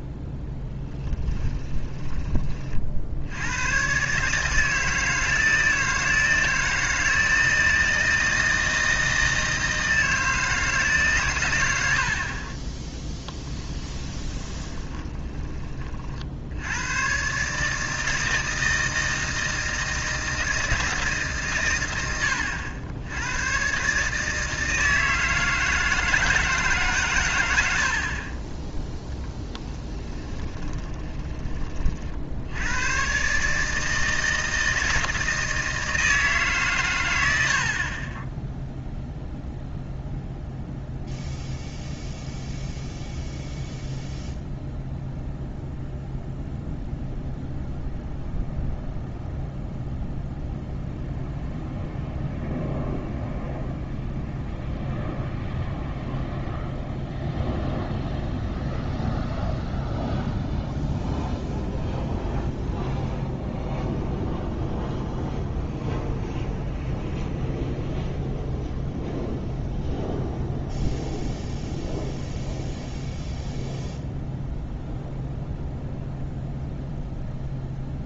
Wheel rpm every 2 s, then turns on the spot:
10, 30, 160, 160, 160, 160, 20, 20, 80, 160, 160, 90, 160, 150, 20, 20, 80, 160, 140, 0, 0, 0, 0, 0, 0, 0, 0, 0, 0, 0, 0, 0, 0, 0, 0, 0, 0, 0, 0.
14-16 30-32